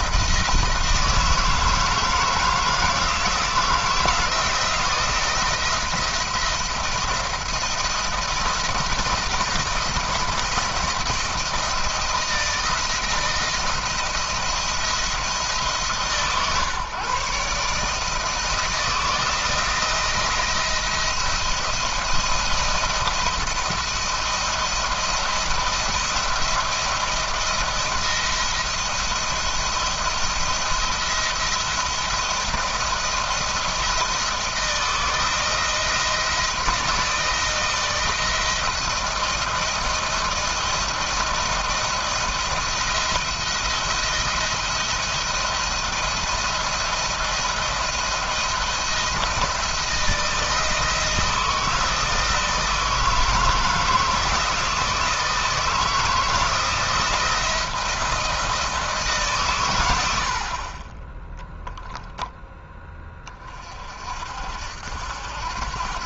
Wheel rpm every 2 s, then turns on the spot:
170, 160, 170, 160, 170, 170, 170, 170, 140, 160, 170, 170, 170, 170, 170, 170, 170, 160, 160, 160, 170, 170, 170, 170, 170, 160, 160, 160, 170, 160, 30, 10, 70.
none